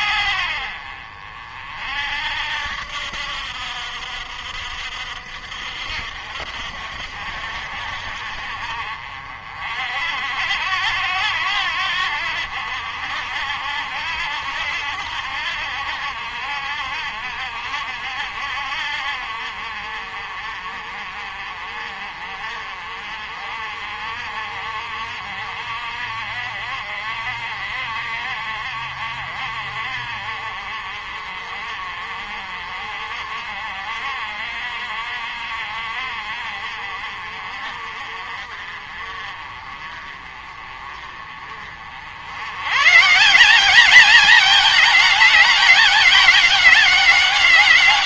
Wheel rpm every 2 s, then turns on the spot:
60, 70, 60, 60, 50, 80, 70, 70, 60, 60, 50, 50, 60, 50, 50, 50, 50, 50, 50, 50, 40, 120, 210, 200.
none